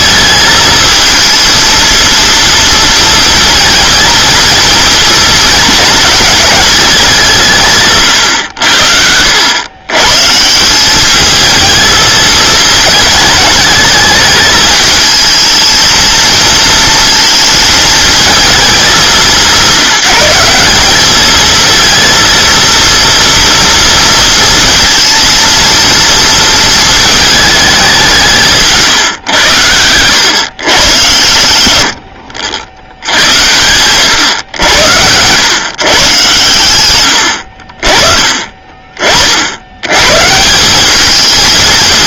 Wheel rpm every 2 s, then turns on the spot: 220, 230, 230, 210, 80, 170, 220, 220, 220, 210, 190, 230, 230, 220, 150, 120, 70, 90, 110, 30, 180.
none